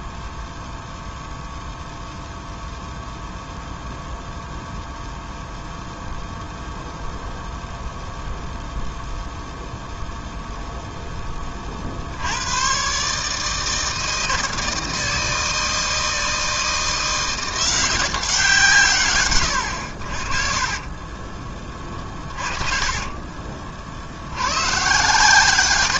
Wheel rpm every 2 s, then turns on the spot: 0, 0, 0, 0, 0, 0, 130, 160, 170, 130, 30, 30, 120.
20-24